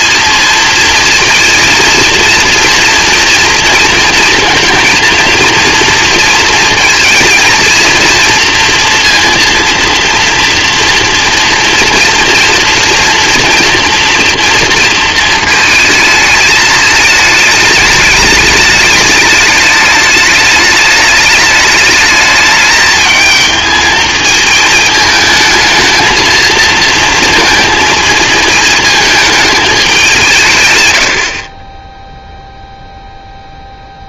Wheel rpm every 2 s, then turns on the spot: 220, 230, 230, 230, 230, 240, 230, 230, 220, 210, 210, 210, 220, 220, 220, 130, 0.
none